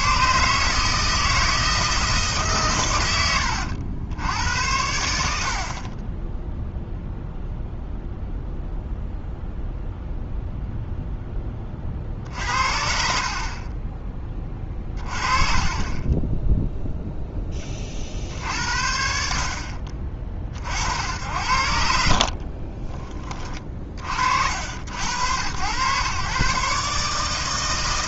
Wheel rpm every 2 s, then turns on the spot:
150, 130, 90, 0, 0, 0, 50, 30, 0, 60, 50, 30, 70, 140.
14-16 22-24